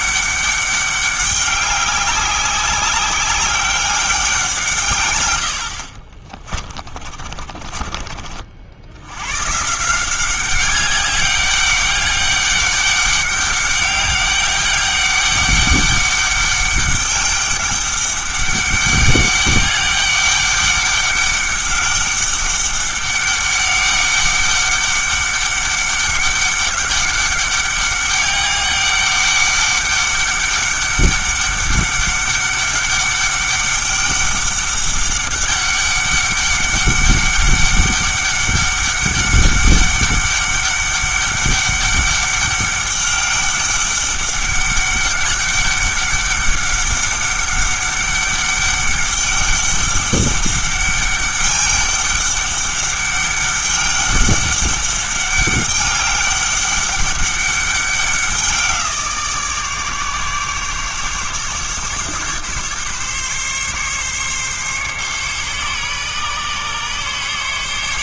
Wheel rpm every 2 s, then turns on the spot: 200, 200, 160, 30, 80, 200, 200, 200, 200, 200, 200, 200, 200, 200, 200, 200, 200, 200, 200, 200, 200, 200, 200, 200, 200, 200, 200, 200, 200, 180, 140, 140, 140, 140.
6-8